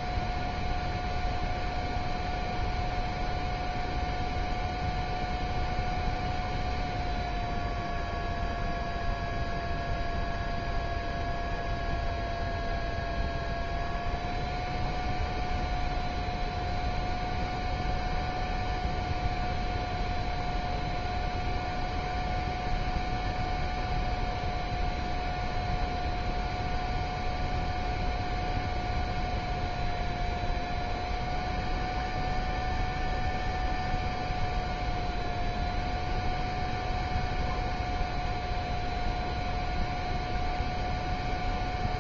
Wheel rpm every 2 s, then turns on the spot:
0, 0, 0, 0, 0, 0, 0, 0, 0, 0, 0, 0, 0, 0, 0, 0, 0, 0, 0, 0, 0.
none